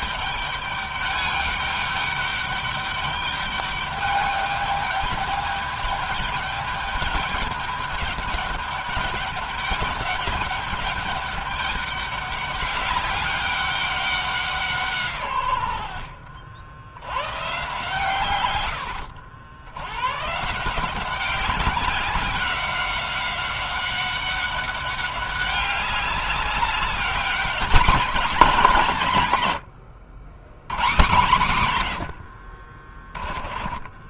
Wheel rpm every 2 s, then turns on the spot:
200, 200, 210, 200, 200, 200, 200, 160, 80, 100, 160, 190, 200, 200, 190, 100, 40.
none